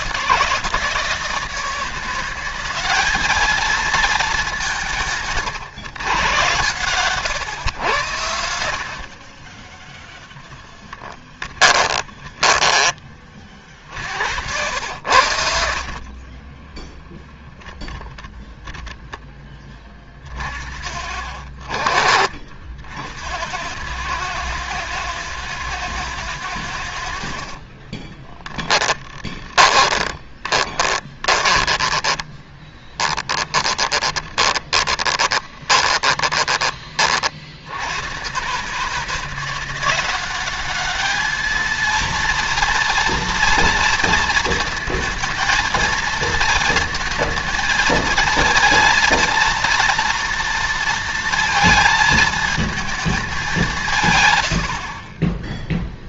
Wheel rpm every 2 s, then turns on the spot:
160, 200, 160, 110, 50, 10, 20, 90, 10, 10, 50, 70, 110, 70, 20, 20, 10, 10, 40, 150, 210, 230, 230, 230, 230, 230, 210, 40.
10-12 26-36